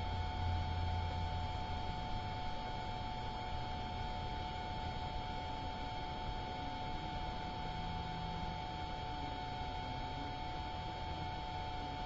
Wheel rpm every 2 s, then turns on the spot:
0, 0, 0, 0, 0, 0.
none